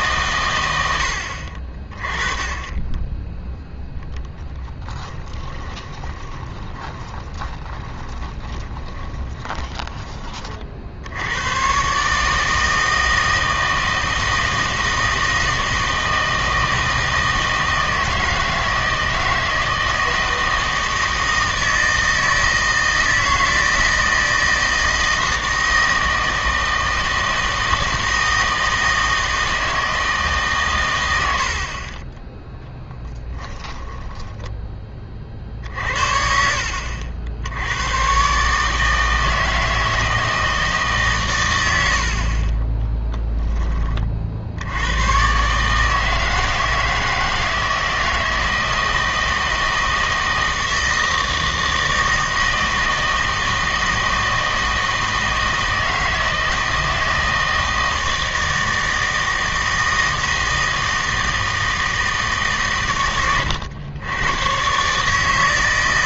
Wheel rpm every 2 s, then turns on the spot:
100, 20, 20, 20, 20, 50, 160, 160, 160, 160, 160, 160, 160, 160, 160, 130, 10, 10, 60, 150, 150, 20, 80, 160, 160, 160, 160, 160, 160, 160, 160, 140, 120.
4-10